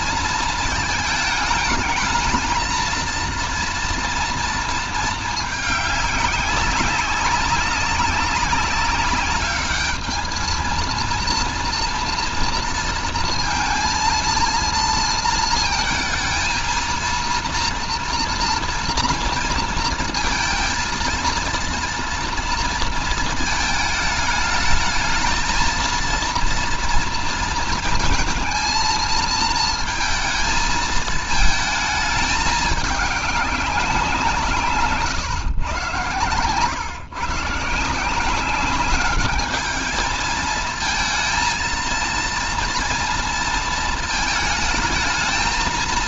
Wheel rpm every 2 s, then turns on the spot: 220, 230, 230, 200, 190, 220, 230, 230, 230, 230, 230, 230, 220, 230, 230, 220, 210, 150, 120, 190, 220, 230, 220.
none